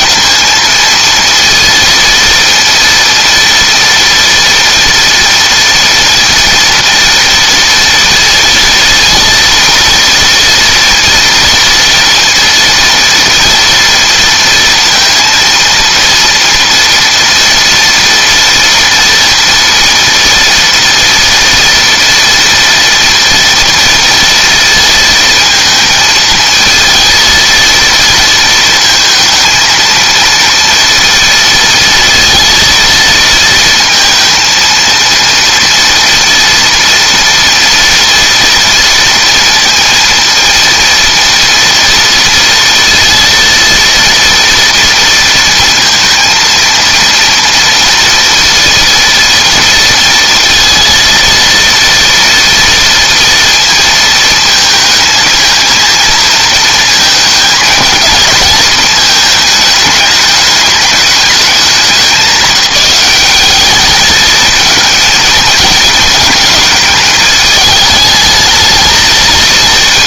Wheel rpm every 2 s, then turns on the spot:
230, 230, 230, 230, 230, 230, 230, 230, 230, 230, 230, 240, 230, 230, 230, 230, 230, 230, 240, 230, 230, 230, 230, 230, 230, 230, 230, 220, 230, 220, 210, 190, 220, 220, 220.
none